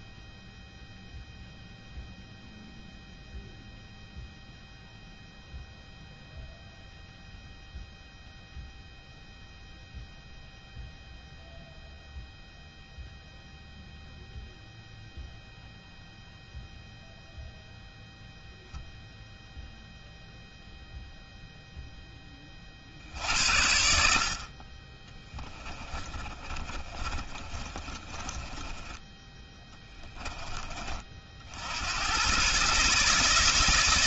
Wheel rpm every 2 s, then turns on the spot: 0, 0, 0, 0, 0, 0, 0, 0, 0, 0, 0, 40, 30, 30, 20, 30, 120.
24-30